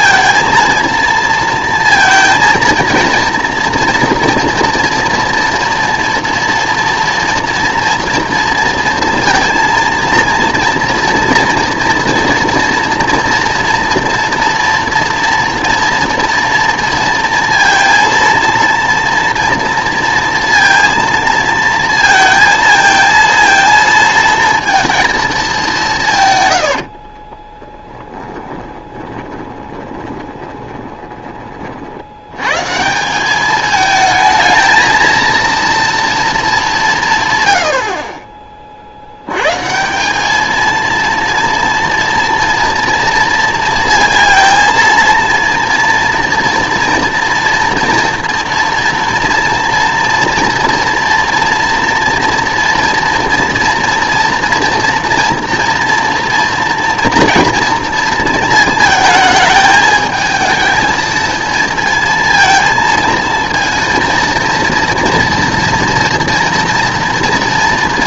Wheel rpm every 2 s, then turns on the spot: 230, 230, 240, 230, 230, 230, 230, 230, 230, 230, 230, 220, 230, 110, 10, 20, 120, 220, 210, 40, 220, 230, 230, 230, 230, 230, 230, 230, 230, 220, 220, 230, 230, 230.
28-32